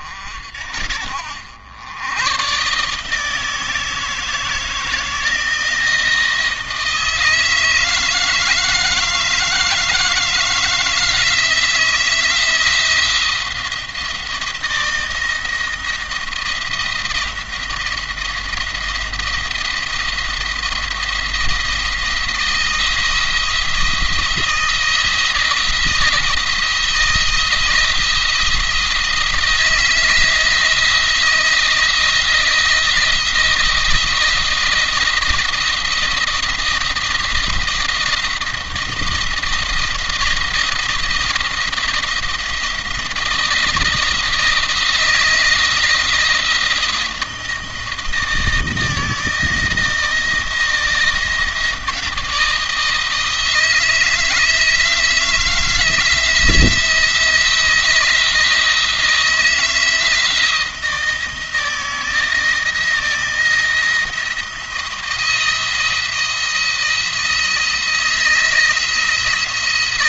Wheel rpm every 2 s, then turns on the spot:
70, 150, 160, 160, 160, 160, 170, 170, 170, 170, 170, 160, 160, 160, 170, 170, 170, 170, 170, 170, 170, 170, 160, 170, 160, 170, 160, 170, 170, 170, 160, 170, 170, 170, 170.
none